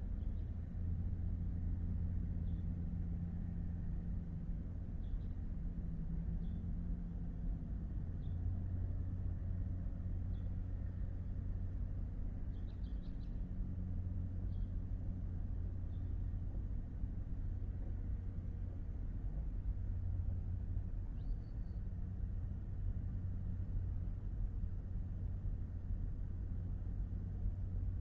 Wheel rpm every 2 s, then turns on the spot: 0, 0, 0, 0, 0, 0, 0, 0, 0, 0, 0, 0, 0, 0.
none